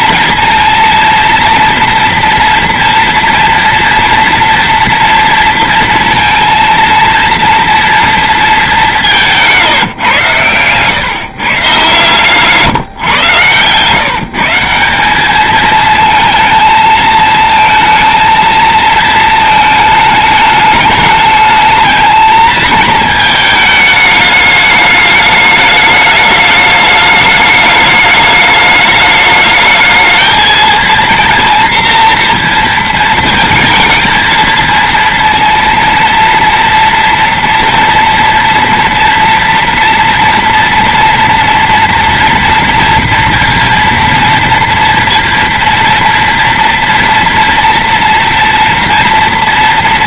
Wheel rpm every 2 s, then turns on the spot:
230, 240, 230, 230, 170, 130, 120, 210, 220, 220, 210, 220, 210, 210, 210, 230, 220, 230, 230, 230, 230, 230, 230, 230, 230.
8-10